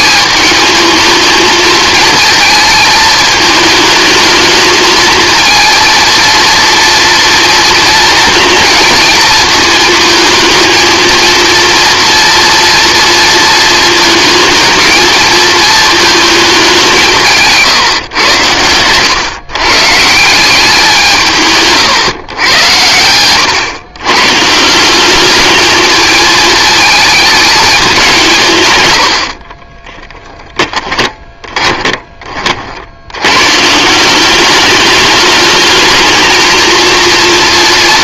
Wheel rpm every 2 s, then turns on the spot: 220, 220, 220, 230, 220, 230, 230, 220, 170, 110, 170, 100, 210, 220, 70, 20, 110, 210, 230.
28-32